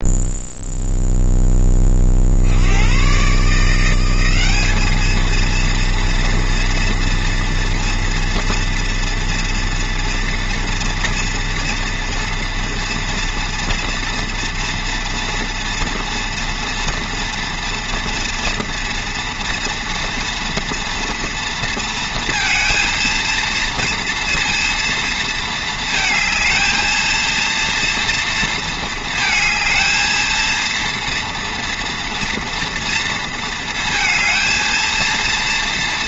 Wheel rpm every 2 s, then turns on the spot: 0, 80, 200, 230, 230, 230, 230, 230, 230, 240, 240, 230, 230, 220, 220, 230, 230, 230.
none